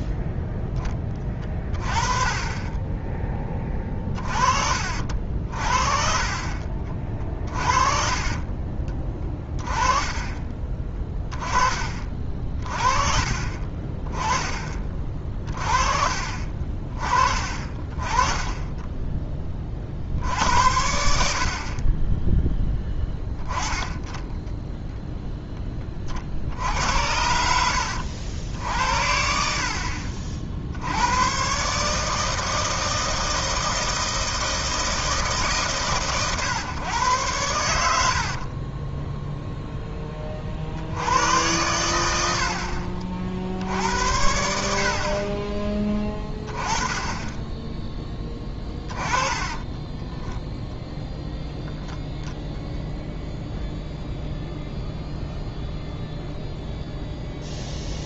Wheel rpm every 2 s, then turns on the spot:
10, 20, 50, 40, 30, 20, 40, 30, 40, 10, 70, 10, 0, 70, 70, 70, 160, 160, 120, 30, 80, 50, 50, 20, 10, 10, 0, 0, 0.
6-10 38-40 48-50